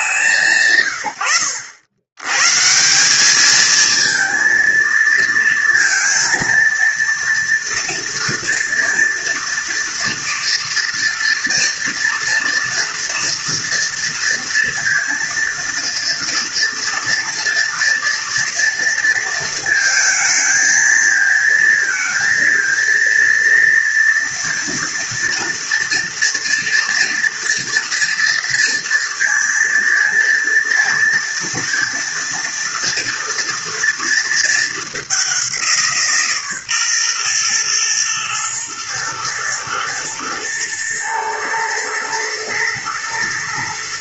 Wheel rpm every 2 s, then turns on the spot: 110, 170, 230, 230, 230, 230, 230, 230, 230, 230, 220, 230, 230, 230, 230, 230, 230, 200, 130, 110, 110, 120.
none